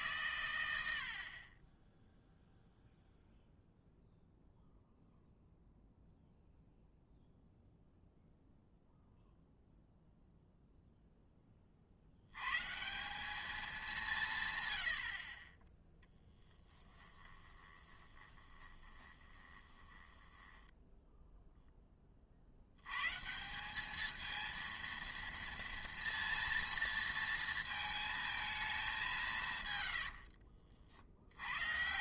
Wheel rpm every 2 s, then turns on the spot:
100, 0, 0, 0, 0, 0, 130, 120, 10, 20, 10, 80, 230, 230, 220, 60.
16-22 30-32